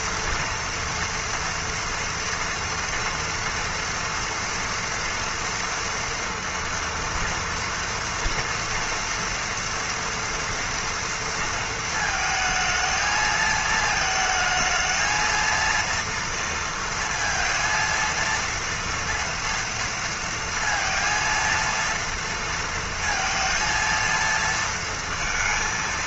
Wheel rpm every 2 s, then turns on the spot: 230, 240, 240, 230, 230, 230, 220, 220, 230, 230, 230, 230, 230.
none